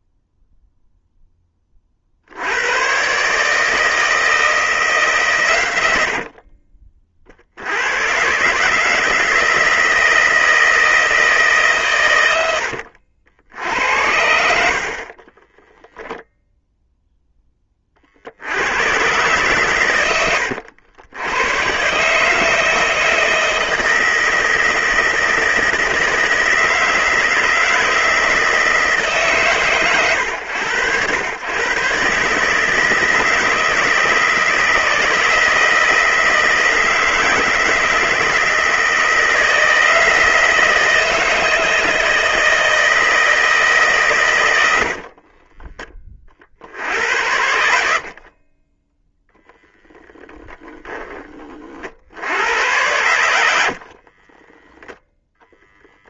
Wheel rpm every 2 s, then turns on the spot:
0, 100, 160, 40, 150, 160, 80, 70, 0, 90, 80, 160, 160, 160, 160, 100, 150, 160, 160, 160, 160, 160, 90, 60, 20, 10, 90, 10.
44-46 48-50 54-56